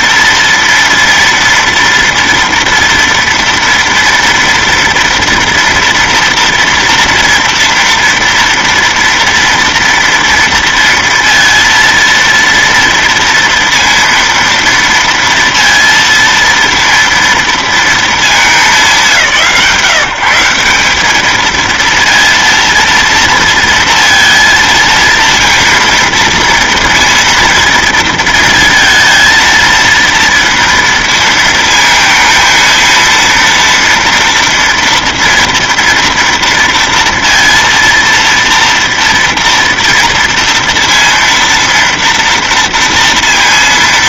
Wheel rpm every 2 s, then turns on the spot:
230, 230, 230, 240, 230, 230, 230, 230, 230, 170, 180, 230, 230, 230, 230, 230, 230, 230, 230, 230, 230, 230.
none